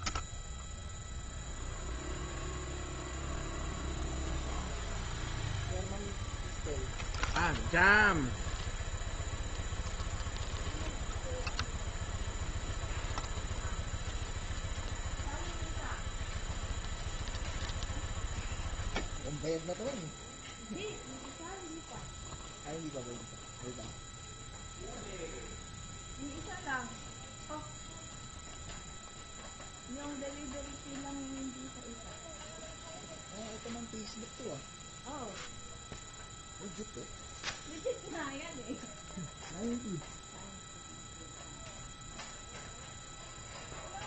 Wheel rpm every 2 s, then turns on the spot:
0, 0, 0, 0, 0, 0, 0, 0, 0, 0, 0, 0, 0, 0, 0, 0, 0, 0, 0, 0, 0, 0.
none